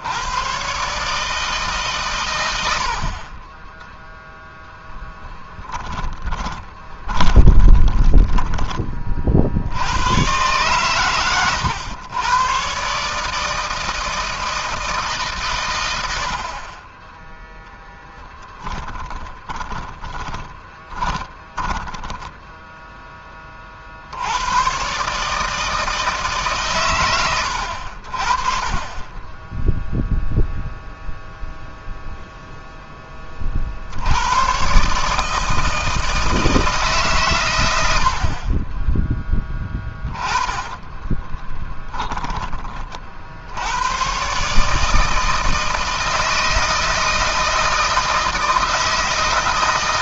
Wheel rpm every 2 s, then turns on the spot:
120, 100, 10, 30, 20, 120, 120, 160, 40, 10, 20, 10, 100, 140, 40, 0, 0, 110, 160, 40, 30, 30, 150, 160, 160.
4-8 18-24 40-42